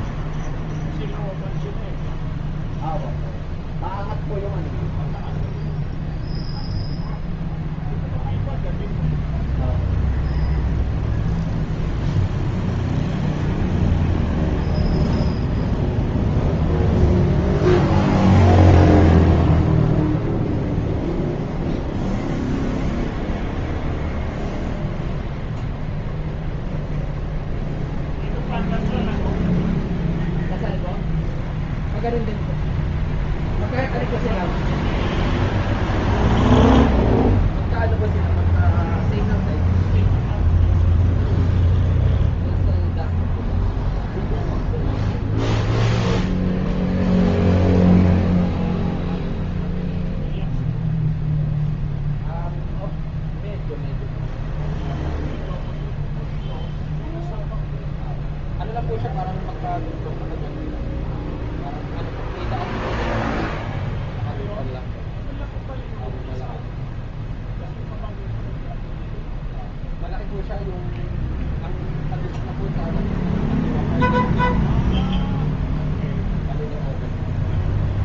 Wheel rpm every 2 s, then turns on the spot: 0, 0, 0, 0, 0, 0, 0, 0, 0, 0, 0, 0, 0, 0, 0, 0, 0, 0, 0, 0, 0, 0, 0, 0, 0, 0, 0, 0, 0, 0, 0, 0, 0, 0, 0, 0, 0, 0, 0.
none